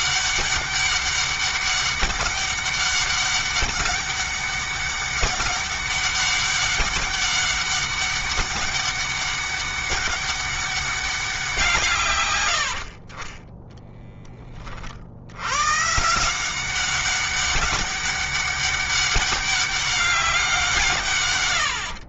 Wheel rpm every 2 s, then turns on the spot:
200, 200, 200, 200, 200, 200, 80, 40, 190, 200, 160.
12-14